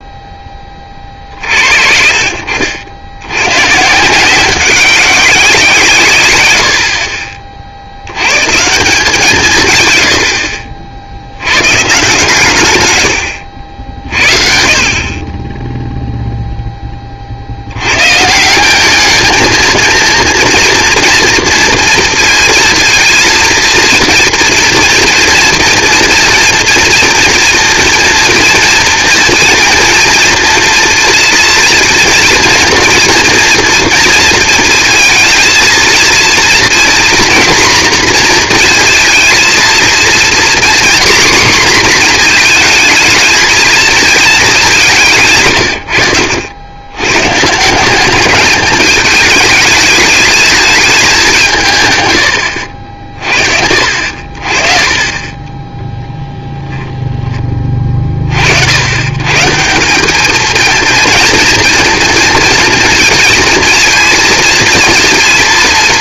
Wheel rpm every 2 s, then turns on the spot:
20, 60, 190, 90, 160, 60, 130, 50, 10, 180, 230, 230, 230, 230, 240, 230, 240, 230, 240, 230, 250, 230, 200, 90, 210, 220, 80, 40, 0, 70, 220, 230, 220.
none